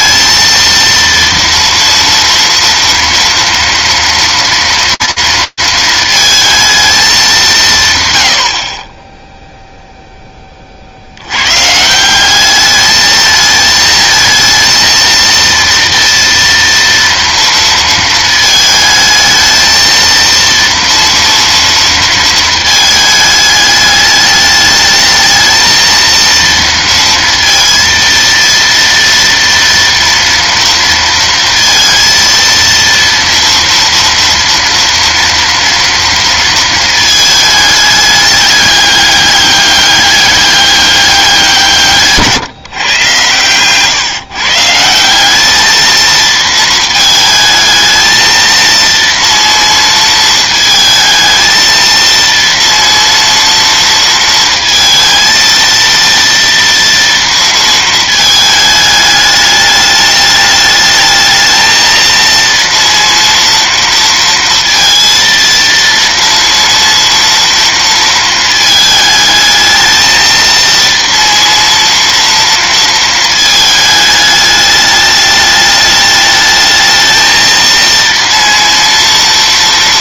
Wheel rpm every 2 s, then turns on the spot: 230, 230, 230, 220, 40, 30, 210, 230, 230, 220, 230, 220, 210, 230, 230, 230, 230, 240, 230, 200, 200, 150, 140, 220, 230, 220, 230, 230, 230, 220, 210, 230, 230, 230, 220, 230, 230, 210, 220, 230.
none